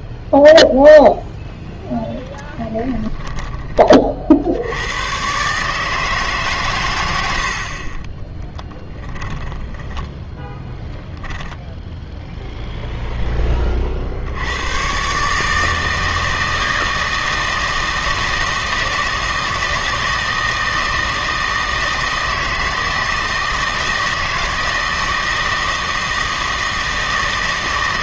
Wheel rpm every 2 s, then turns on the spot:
0, 10, 80, 120, 10, 10, 0, 100, 160, 160, 160, 160, 160, 160.
8-10